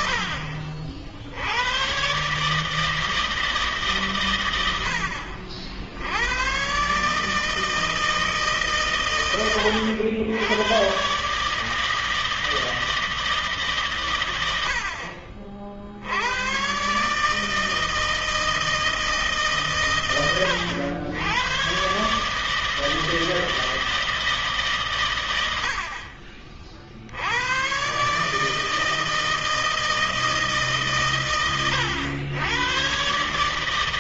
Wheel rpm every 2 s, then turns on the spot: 70, 140, 110, 100, 150, 110, 160, 90, 140, 160, 90, 160, 130, 70, 160, 140, 130.
none